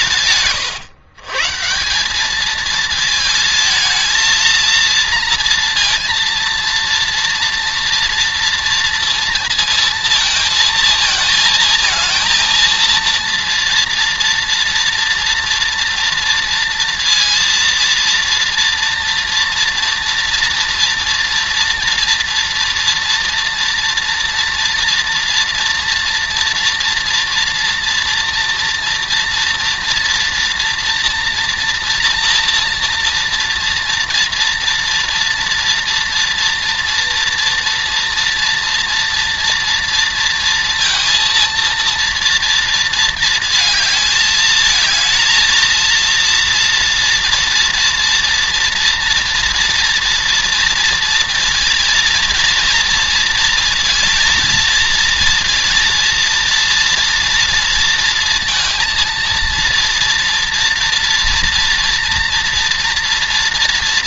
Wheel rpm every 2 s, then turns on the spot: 140, 220, 230, 230, 230, 220, 230, 230, 230, 230, 230, 230, 240, 230, 230, 240, 230, 230, 240, 230, 230, 230, 220, 230, 240, 230, 230, 230, 230, 230, 230, 230.
none